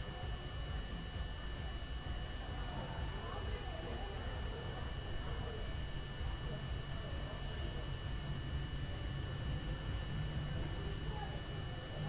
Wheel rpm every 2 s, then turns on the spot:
0, 0, 0, 0, 0, 0.
none